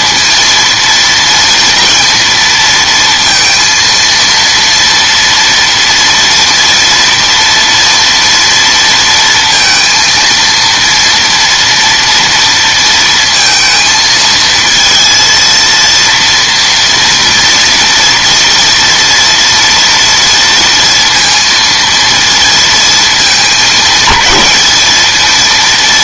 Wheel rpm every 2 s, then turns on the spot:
230, 230, 230, 230, 230, 230, 230, 230, 230, 230, 230, 230, 210.
none